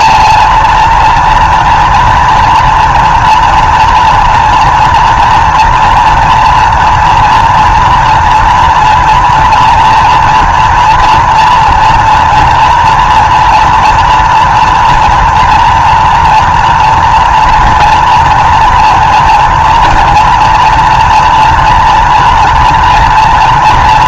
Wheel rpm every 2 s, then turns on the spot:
230, 230, 230, 230, 230, 230, 240, 240, 230, 240, 230, 230.
none